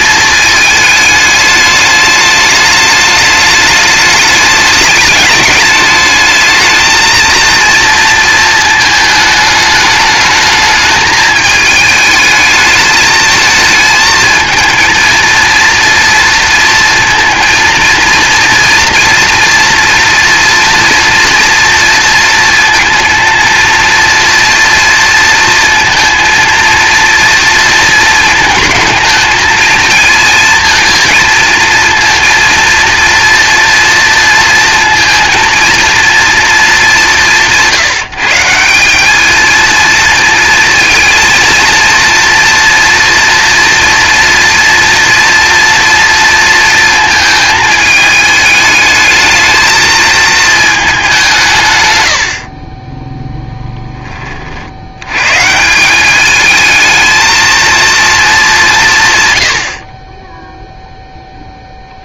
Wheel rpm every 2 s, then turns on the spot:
210, 210, 210, 230, 220, 210, 220, 220, 230, 230, 230, 230, 230, 230, 220, 230, 230, 230, 190, 210, 230, 230, 230, 220, 220, 190, 10, 110, 220, 120, 0.
none